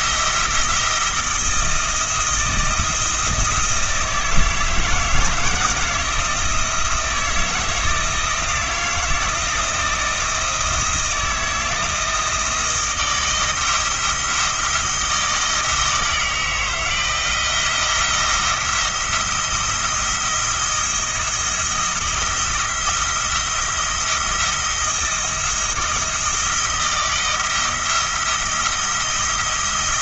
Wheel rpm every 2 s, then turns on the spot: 170, 170, 160, 160, 170, 170, 170, 160, 160, 170, 170, 170, 170, 170, 170.
none